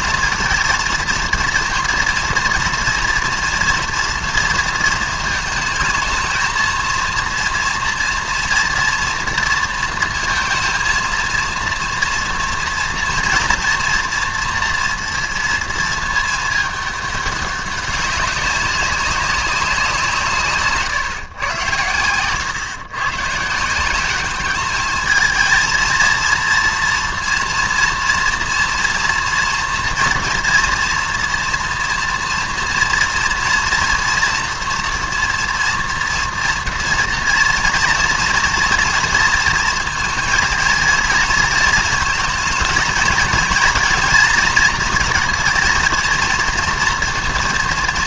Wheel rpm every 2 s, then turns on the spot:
230, 230, 230, 220, 230, 230, 230, 230, 220, 200, 180, 100, 190, 230, 230, 230, 230, 240, 240, 230, 230, 230, 230, 230.
none